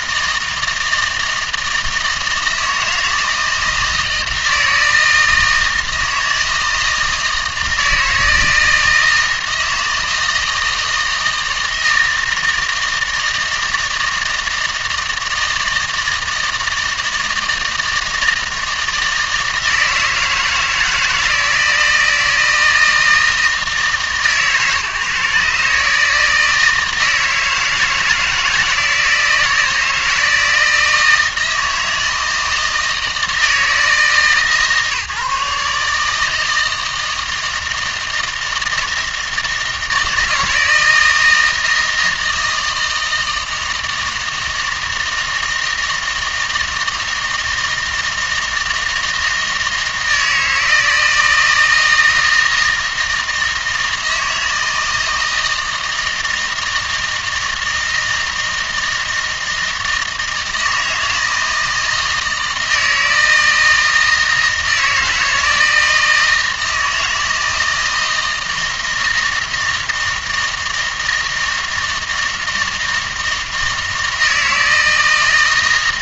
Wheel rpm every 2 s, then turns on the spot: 160, 160, 160, 160, 160, 160, 160, 160, 160, 160, 160, 160, 150, 160, 160, 160, 160, 150, 160, 160, 160, 160, 160, 160, 160, 160, 160, 160, 160, 160, 160, 160, 160, 160, 160, 160, 160, 160.
none